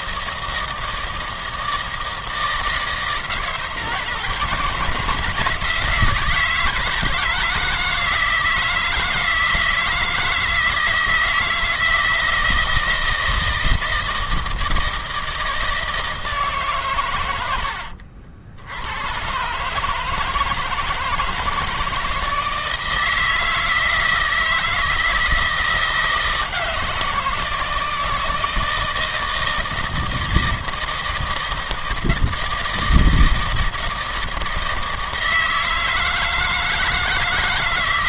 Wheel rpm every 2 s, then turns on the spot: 160, 160, 160, 160, 160, 160, 160, 160, 130, 110, 160, 160, 160, 170, 160, 160, 160, 160, 160.
none